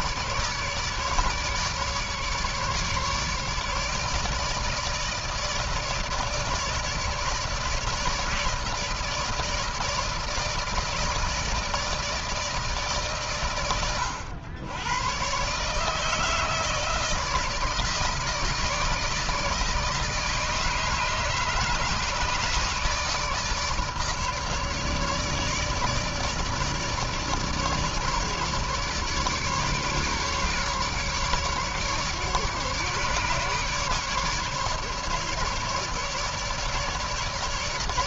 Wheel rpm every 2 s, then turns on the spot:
150, 150, 160, 150, 160, 160, 130, 130, 160, 160, 150, 150, 150, 150, 150, 150, 150, 150, 150.
none